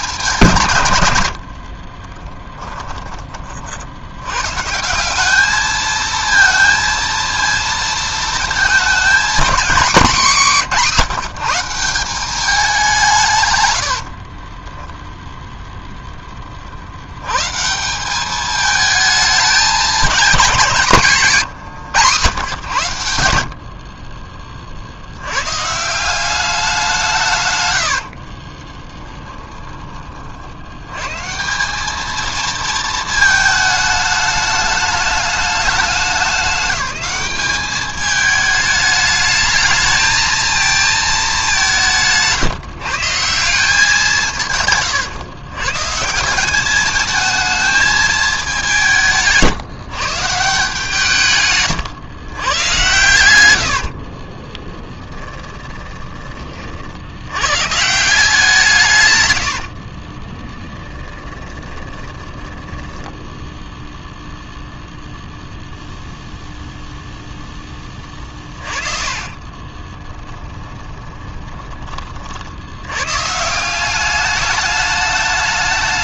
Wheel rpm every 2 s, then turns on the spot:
120, 10, 160, 230, 220, 190, 180, 10, 50, 220, 200, 110, 60, 180, 20, 90, 220, 210, 200, 210, 220, 150, 130, 200, 190, 150, 120, 20, 50, 140, 10, 10, 0, 0, 30, 20, 90, 210.
14-16 28-30 44-46 54-56 60-64 68-72